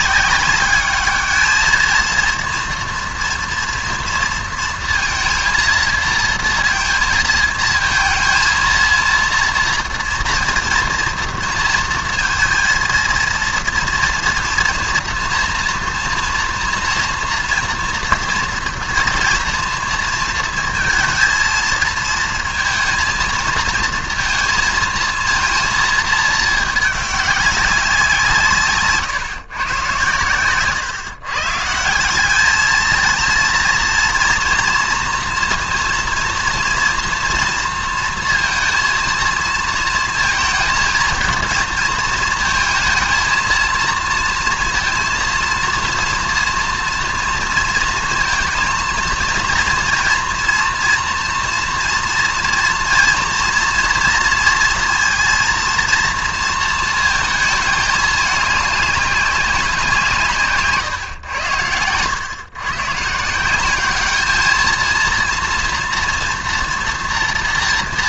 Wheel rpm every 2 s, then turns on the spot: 200, 230, 230, 230, 230, 230, 230, 230, 230, 230, 230, 230, 230, 210, 150, 130, 220, 230, 230, 230, 230, 230, 230, 230, 230, 230, 230, 230, 230, 200, 140, 130, 220, 240.
none